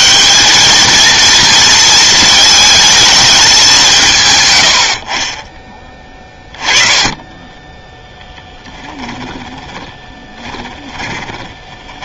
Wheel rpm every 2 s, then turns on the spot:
220, 220, 80, 20, 30, 20.
6-12